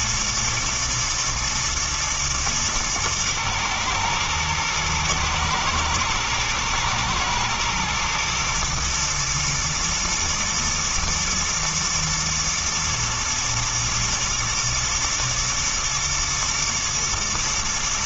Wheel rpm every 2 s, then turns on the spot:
120, 120, 120, 110, 120, 120, 110, 110, 120.
none